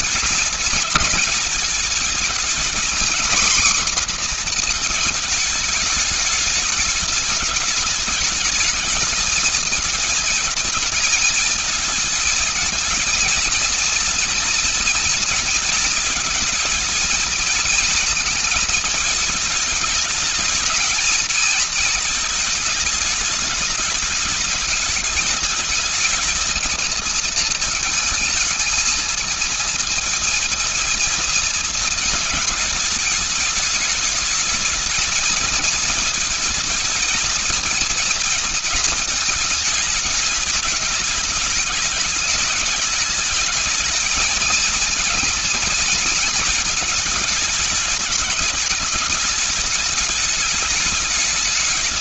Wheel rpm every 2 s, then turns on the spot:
220, 230, 250, 210, 220, 220, 220, 230, 220, 220, 220, 220, 210, 220, 220, 230, 220, 210, 220, 220, 210, 210, 220, 220, 210, 210.
none